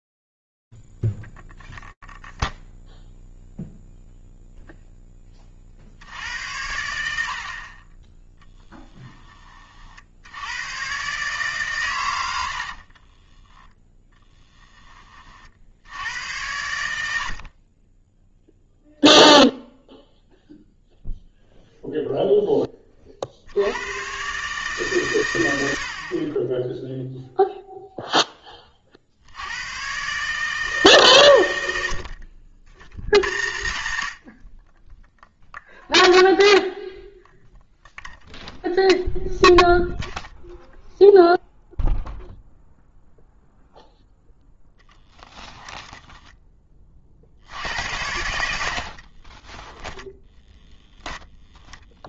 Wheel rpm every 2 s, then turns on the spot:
0, 0, 0, 80, 20, 80, 90, 20, 90, 0, 0, 20, 140, 10, 50, 130, 90, 10, 0, 0, 0, 0, 10, 70, 20, 10.
14-16 44-46 48-50